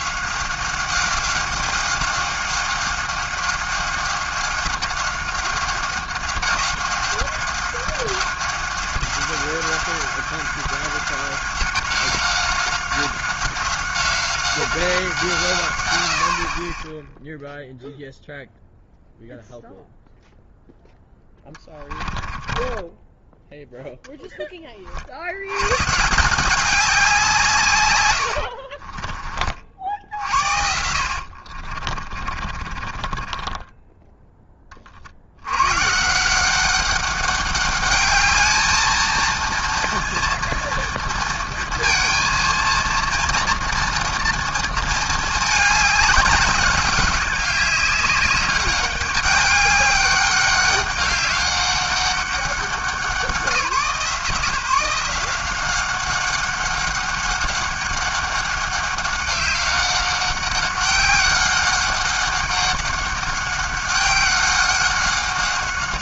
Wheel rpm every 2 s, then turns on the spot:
190, 190, 190, 190, 190, 190, 190, 180, 20, 0, 10, 20, 30, 190, 40, 60, 30, 30, 190, 220, 230, 230, 230, 200, 200, 200, 190, 160, 200, 190, 190, 200, 190.
22-24 28-34